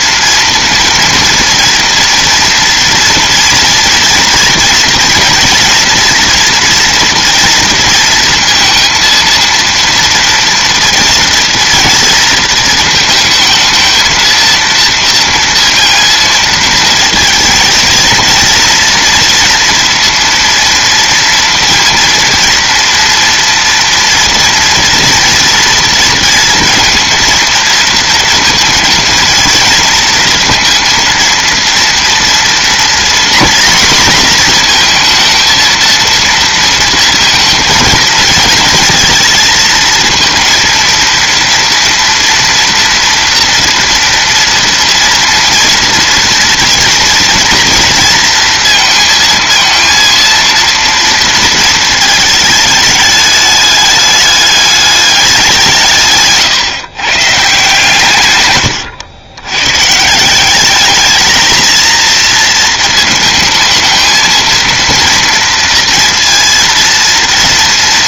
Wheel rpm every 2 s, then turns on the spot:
230, 230, 230, 230, 230, 230, 230, 230, 230, 240, 230, 230, 240, 230, 230, 230, 240, 230, 230, 230, 230, 230, 230, 230, 230, 230, 210, 210, 140, 110, 200, 230, 230, 230.
58-60